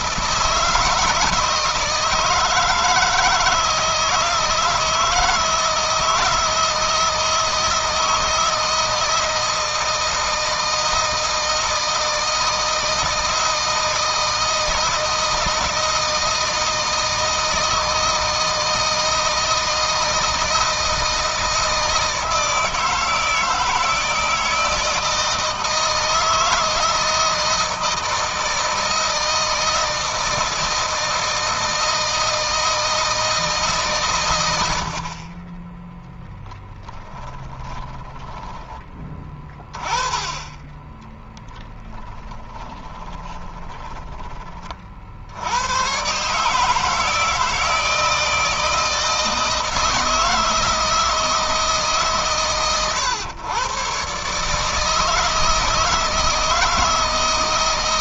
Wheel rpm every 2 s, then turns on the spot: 160, 160, 160, 160, 160, 160, 160, 160, 160, 160, 160, 160, 160, 160, 160, 160, 160, 50, 10, 20, 20, 20, 50, 160, 160, 160, 120, 160, 160.
36-38 40-44